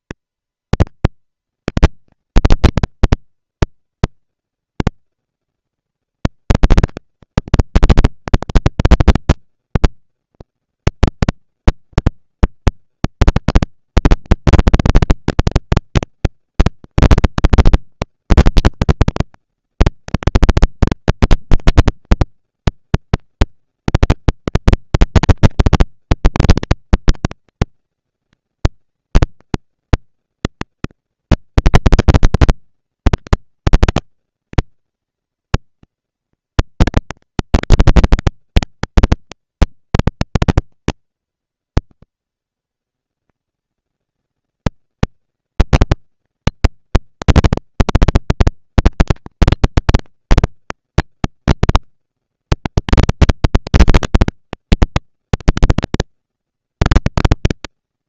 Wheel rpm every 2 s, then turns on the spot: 230, 220, 230, 230, 230, 230, 240, 230, 230, 210, 200, 200, 230, 230, 220, 230, 230, 230, 230, 230, 230, 220, 220, 220, 230, 230, 230, 230, 230.
none